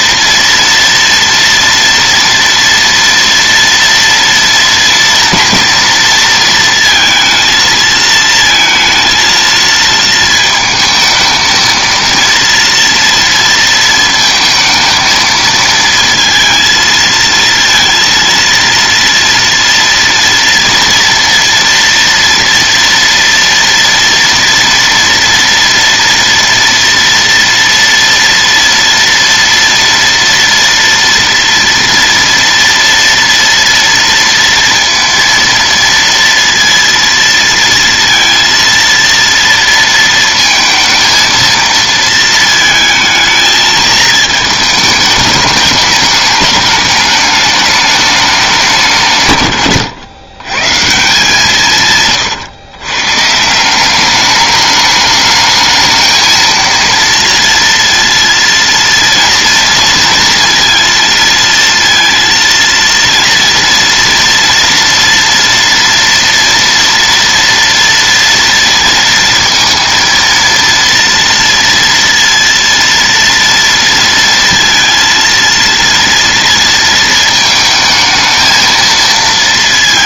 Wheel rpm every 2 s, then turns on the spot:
230, 230, 230, 230, 230, 220, 230, 230, 230, 230, 240, 230, 230, 230, 230, 230, 230, 230, 230, 230, 230, 220, 210, 210, 190, 130, 120, 210, 230, 230, 230, 230, 230, 230, 230, 230, 230, 230, 230, 220.
none